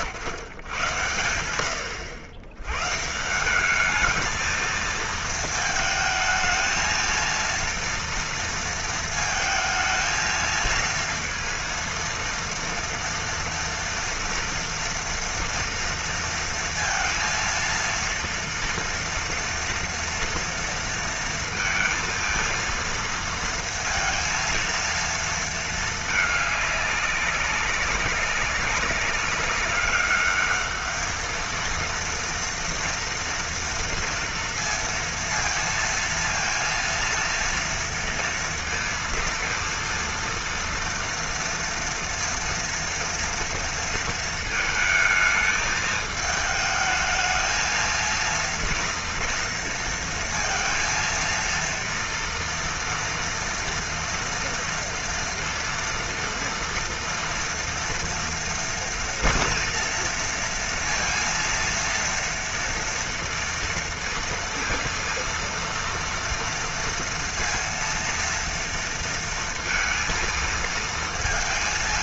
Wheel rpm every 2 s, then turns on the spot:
130, 100, 220, 220, 230, 230, 230, 230, 230, 230, 230, 230, 230, 210, 190, 210, 230, 230, 230, 230, 230, 230, 220, 220, 230, 230, 230, 230, 230, 230, 230, 230, 230, 230, 230, 220.
none